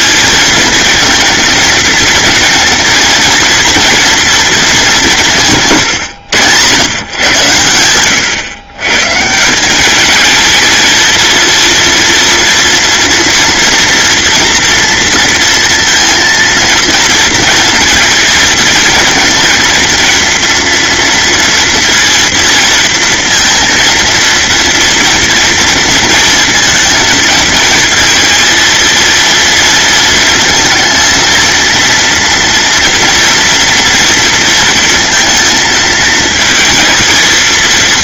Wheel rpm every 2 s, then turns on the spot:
230, 230, 190, 120, 140, 230, 230, 230, 230, 220, 230, 230, 230, 230, 230, 220, 230, 230, 230.
none